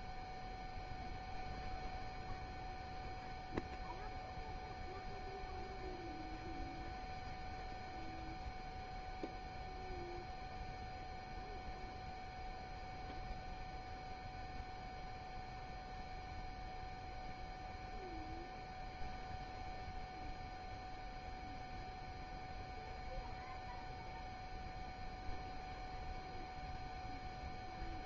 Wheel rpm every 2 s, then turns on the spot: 0, 0, 0, 0, 0, 0, 0, 0, 0, 0, 0, 0, 0, 0.
none